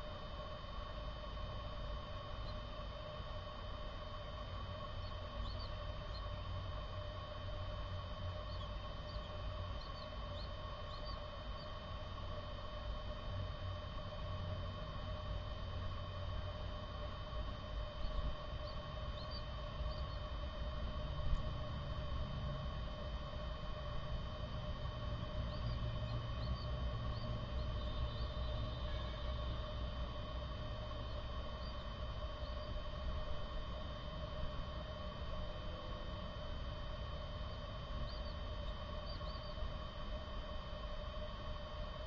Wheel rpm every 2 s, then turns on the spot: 0, 0, 0, 0, 0, 0, 0, 0, 0, 0, 0, 0, 0, 0, 0, 0, 0, 0, 0, 0, 0.
none